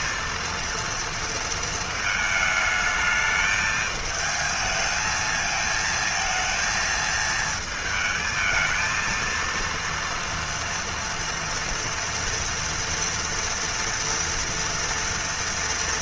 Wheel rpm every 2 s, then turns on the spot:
230, 220, 220, 220, 220, 230, 230, 240.
none